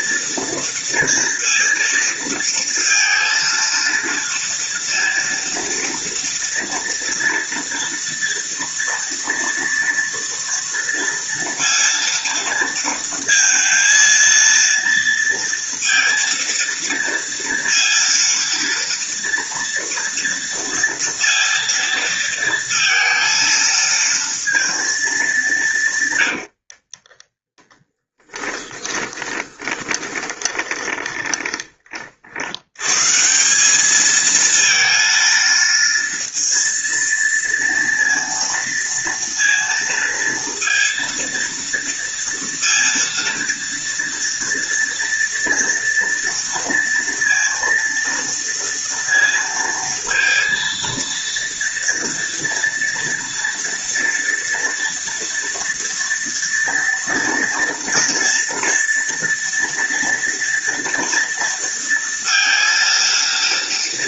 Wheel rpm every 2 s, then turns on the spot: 230, 230, 230, 230, 230, 230, 230, 230, 230, 230, 230, 230, 230, 60, 10, 20, 110, 230, 230, 230, 230, 230, 230, 230, 230, 230, 230, 230, 230, 230, 230, 230.
26-32